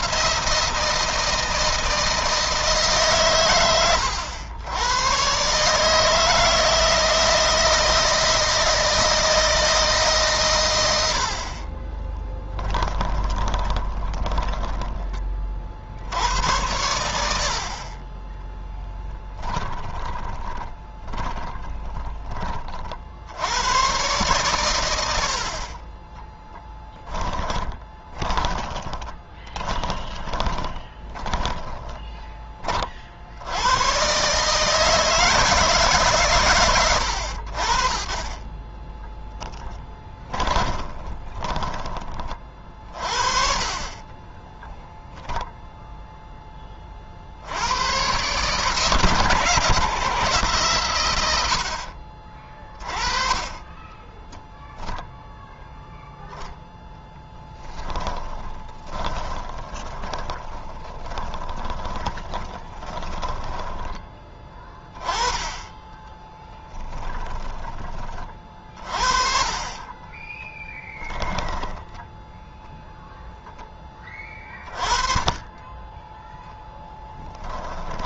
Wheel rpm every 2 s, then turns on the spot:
160, 130, 120, 160, 160, 90, 20, 20, 80, 10, 30, 50, 90, 20, 20, 20, 60, 150, 90, 10, 30, 40, 0, 40, 140, 110, 30, 0, 10, 30, 20, 20, 20, 10, 40, 10, 0, 30, 10.
12-14 18-22 26-32 38-42 58-64 66-68 70-72 76-78